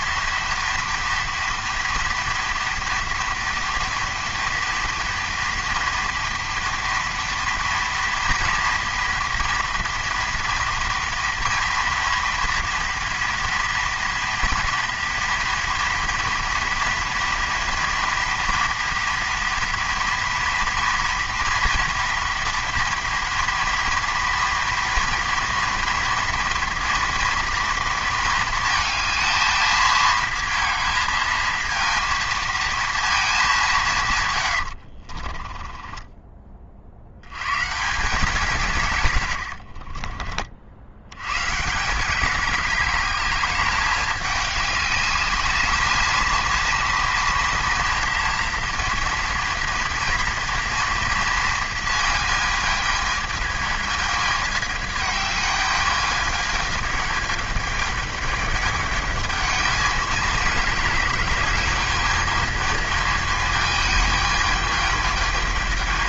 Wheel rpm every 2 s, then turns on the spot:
230, 230, 230, 230, 230, 230, 230, 230, 230, 230, 230, 230, 230, 230, 220, 230, 230, 70, 60, 140, 70, 200, 210, 230, 230, 230, 220, 210, 210, 210, 210, 220, 210.
34-36